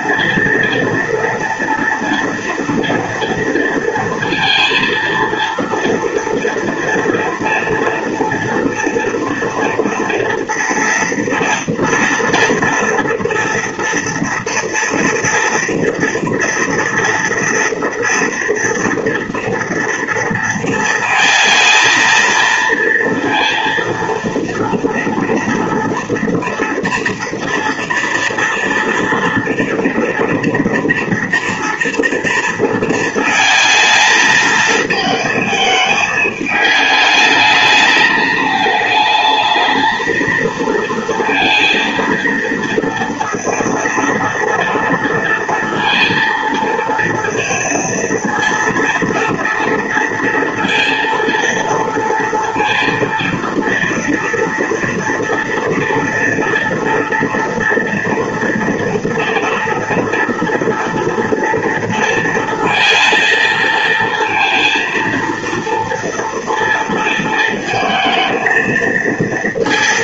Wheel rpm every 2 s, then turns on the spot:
230, 230, 230, 240, 230, 240, 230, 230, 230, 230, 230, 230, 230, 230, 230, 230, 220, 220, 220, 220, 230, 230, 230, 230, 230, 230, 230, 230, 240, 230, 230, 230, 230, 230, 230.
none